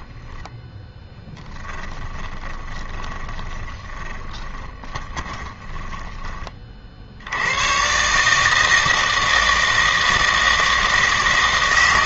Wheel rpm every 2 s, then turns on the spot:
0, 20, 20, 50, 160, 160.
2-6